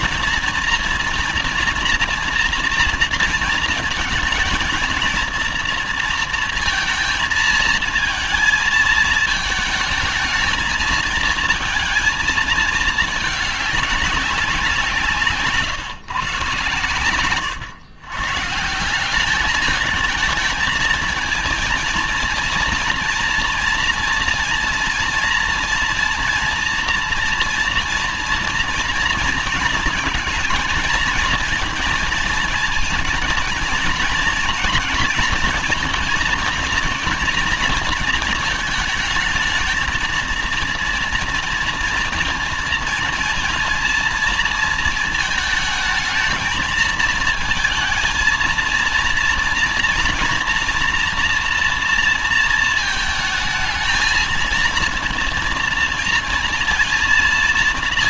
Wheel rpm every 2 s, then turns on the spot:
230, 230, 220, 230, 220, 220, 220, 190, 140, 140, 220, 230, 240, 240, 240, 230, 230, 240, 230, 230, 230, 230, 230, 220, 230, 230, 230, 230, 230.
none